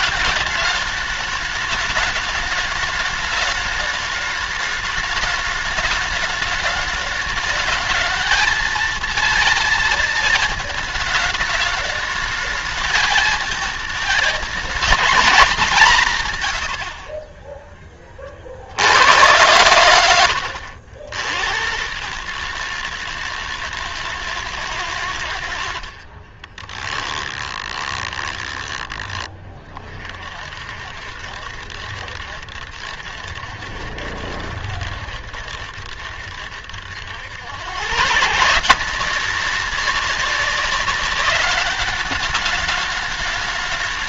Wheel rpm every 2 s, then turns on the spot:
210, 210, 210, 210, 230, 220, 220, 220, 80, 70, 80, 120, 100, 20, 20, 60, 70, 70, 80, 180, 200, 210.
26-28